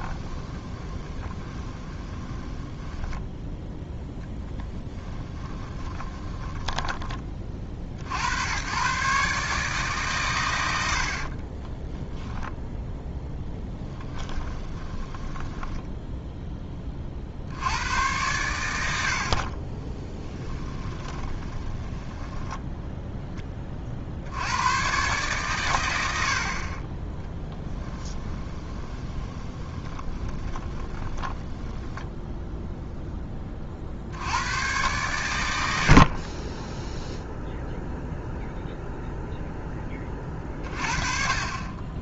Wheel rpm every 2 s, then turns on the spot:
20, 10, 10, 20, 100, 80, 0, 10, 20, 90, 20, 10, 110, 30, 20, 10, 0, 110, 10, 0, 30.
0-8 14-16 20-24 28-32